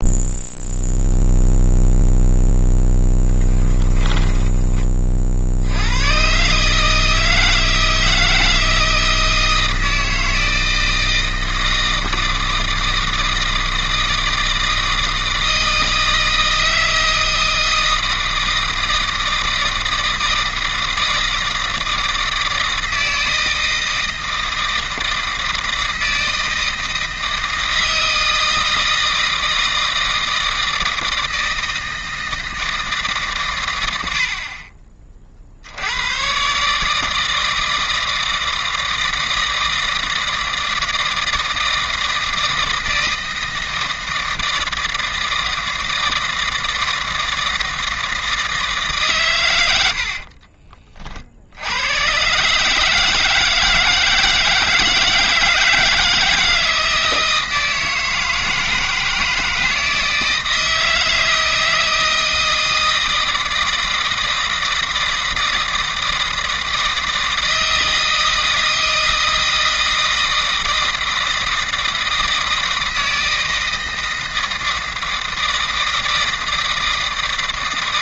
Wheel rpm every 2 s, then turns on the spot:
0, 10, 50, 160, 160, 160, 160, 160, 160, 160, 160, 160, 160, 160, 160, 160, 140, 40, 160, 160, 160, 160, 160, 160, 130, 60, 160, 160, 160, 160, 160, 160, 160, 160, 160, 160, 160, 160, 160.
2-4